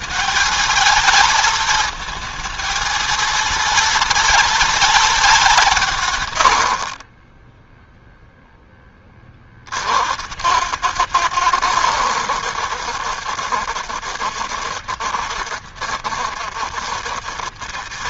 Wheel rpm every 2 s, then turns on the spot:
220, 230, 220, 60, 20, 100, 70, 70, 80.
6-8